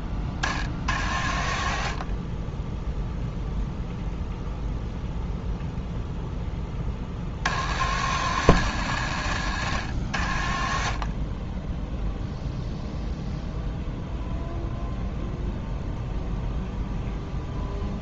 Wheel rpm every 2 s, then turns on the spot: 60, 10, 0, 20, 100, 40, 0, 0, 0.
none